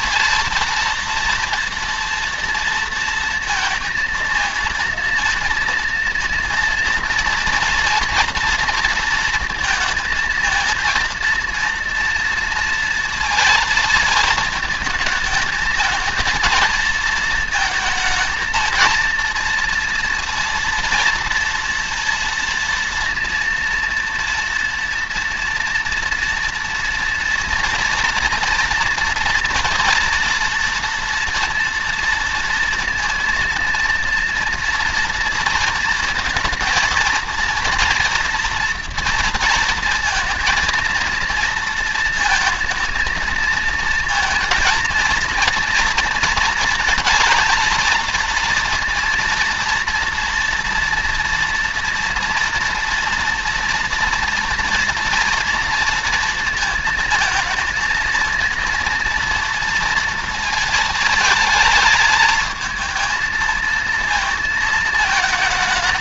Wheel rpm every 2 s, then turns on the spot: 230, 230, 230, 230, 230, 230, 230, 220, 220, 230, 230, 230, 230, 230, 230, 230, 230, 240, 230, 230, 230, 230, 230, 230, 230, 230, 240, 230, 230, 230, 230, 220, 220.
none